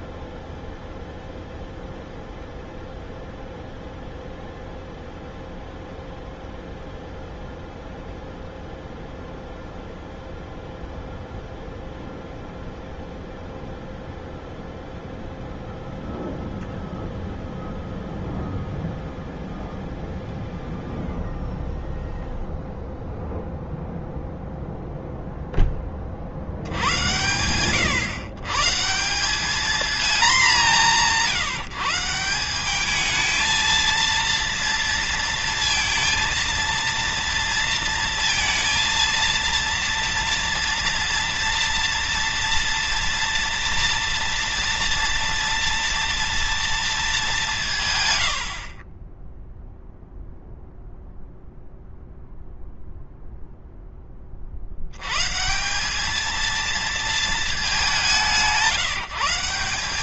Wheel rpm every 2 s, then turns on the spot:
0, 0, 0, 0, 0, 0, 0, 0, 0, 0, 0, 0, 0, 80, 160, 170, 200, 230, 230, 230, 230, 230, 240, 220, 40, 0, 0, 80, 230, 180.
48-50